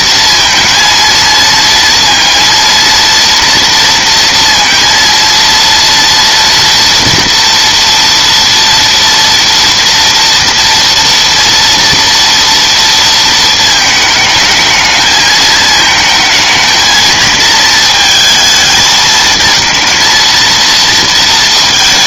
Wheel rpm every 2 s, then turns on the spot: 230, 230, 230, 230, 230, 230, 230, 220, 220, 220, 230.
none